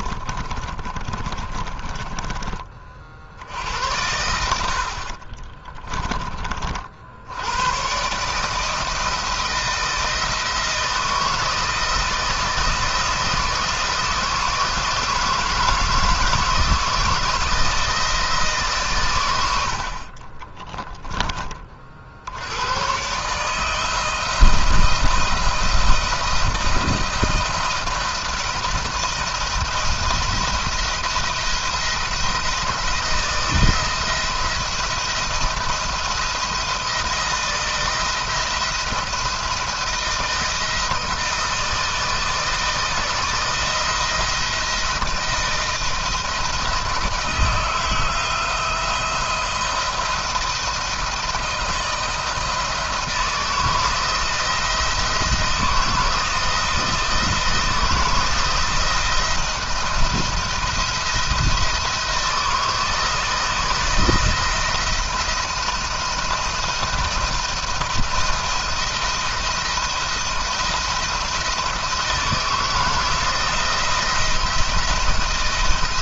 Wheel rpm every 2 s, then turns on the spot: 30, 20, 70, 40, 150, 160, 160, 160, 160, 150, 20, 80, 170, 170, 170, 170, 170, 170, 170, 170, 170, 160, 160, 170, 170, 170, 160, 170, 160, 160, 170, 160, 170, 170, 170, 170, 160, 170.
0-2 20-22